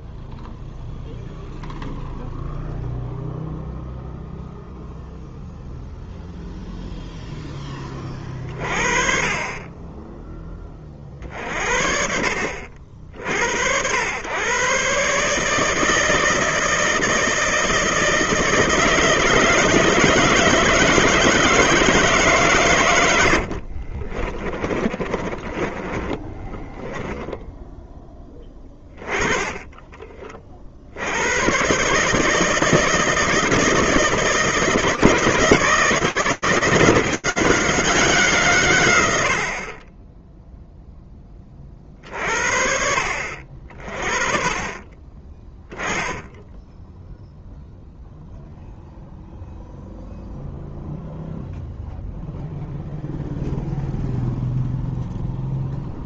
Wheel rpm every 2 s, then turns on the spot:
0, 0, 0, 0, 30, 10, 60, 110, 160, 160, 160, 130, 30, 10, 20, 40, 160, 160, 180, 110, 0, 60, 30, 10, 0, 0, 0, 0.
24-28